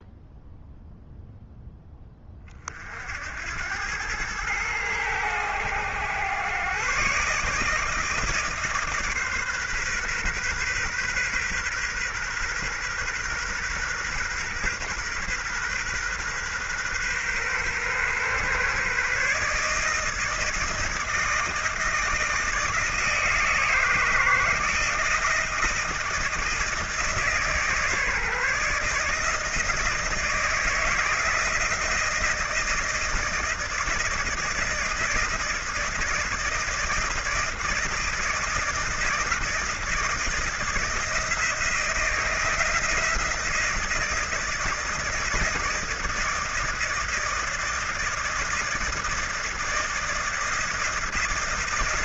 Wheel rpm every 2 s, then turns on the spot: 0, 50, 100, 130, 150, 120, 130, 130, 130, 140, 160, 160, 160, 160, 150, 160, 160, 160, 160, 160, 160, 170, 160, 160, 160, 170.
none